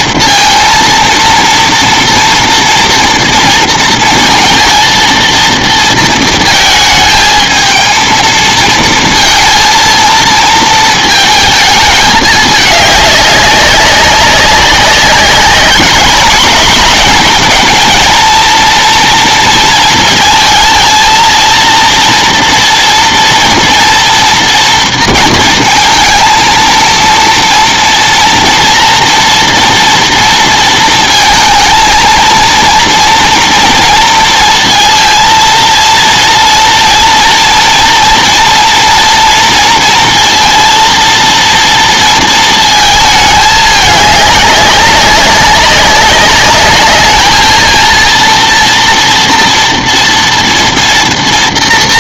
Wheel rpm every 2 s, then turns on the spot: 230, 230, 230, 220, 220, 220, 210, 190, 220, 230, 230, 230, 230, 230, 230, 230, 230, 230, 230, 230, 230, 230, 200, 210, 230, 230.
none